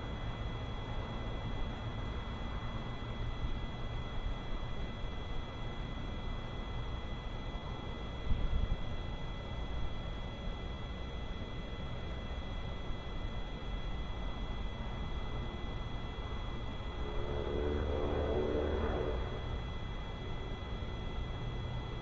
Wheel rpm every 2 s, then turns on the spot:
0, 0, 0, 0, 0, 0, 0, 0, 0, 0, 0.
none